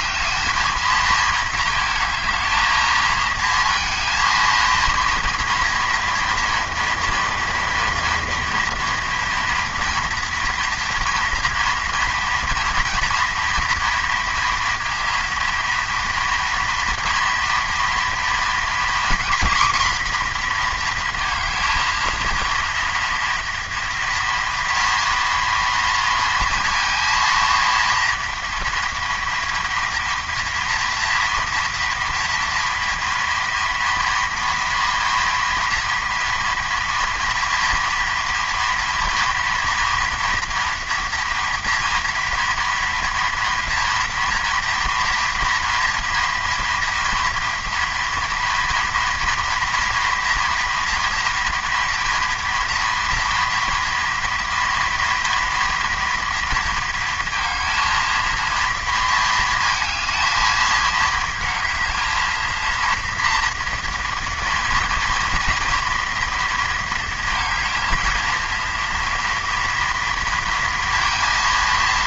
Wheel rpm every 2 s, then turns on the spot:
220, 220, 230, 230, 240, 230, 230, 230, 230, 240, 230, 230, 230, 230, 230, 230, 230, 230, 230, 230, 240, 230, 230, 240, 230, 230, 230, 230, 220, 220, 220, 230, 230, 220, 230, 230.
none